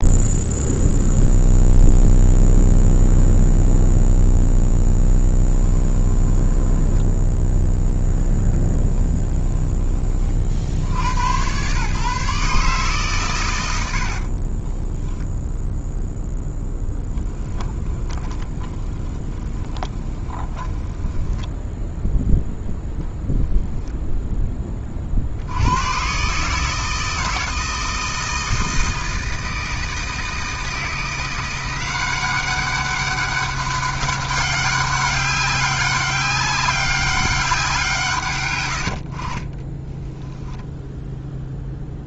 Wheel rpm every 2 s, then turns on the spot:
0, 0, 0, 10, 10, 80, 140, 20, 10, 20, 10, 0, 20, 160, 160, 160, 200, 200, 190, 80, 0.
6-10 14-22